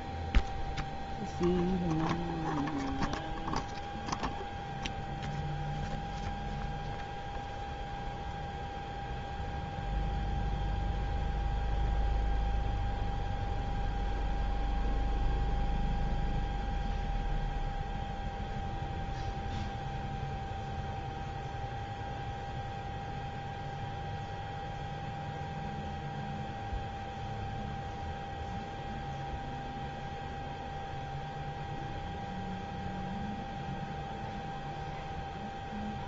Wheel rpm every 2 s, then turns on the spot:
0, 0, 0, 0, 0, 0, 0, 0, 0, 0, 0, 0, 0, 0, 0, 0, 0, 0.
none